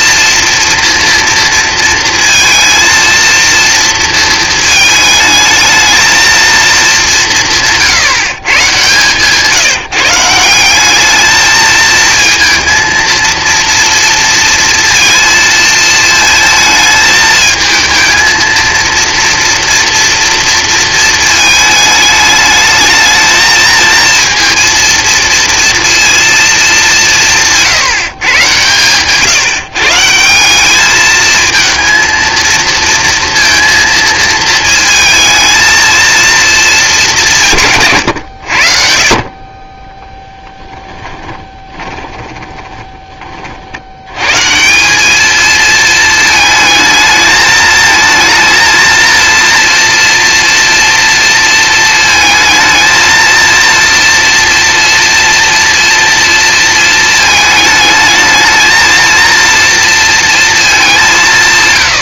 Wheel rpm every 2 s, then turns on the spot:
230, 230, 220, 220, 130, 190, 230, 230, 220, 230, 230, 210, 230, 210, 130, 200, 230, 220, 230, 80, 10, 10, 160, 220, 230, 230, 220, 240, 230, 220, 220.
40-44